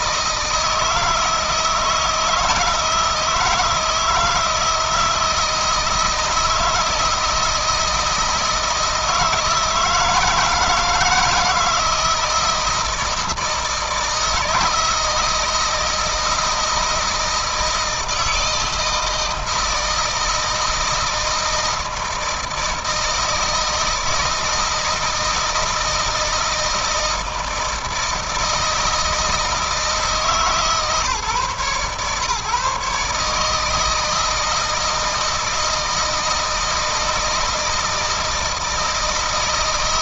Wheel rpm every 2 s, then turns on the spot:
160, 160, 160, 160, 160, 160, 160, 160, 160, 160, 160, 160, 160, 160, 160, 140, 150, 160, 160, 160.
none